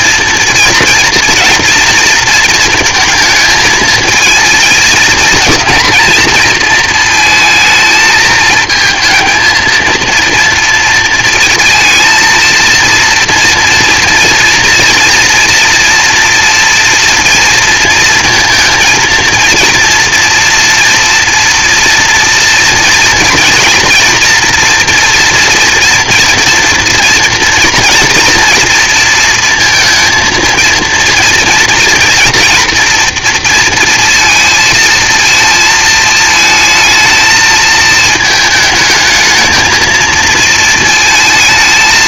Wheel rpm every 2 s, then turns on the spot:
230, 230, 230, 230, 220, 230, 230, 230, 240, 230, 230, 230, 230, 240, 230, 230, 230, 230, 220, 220, 230.
none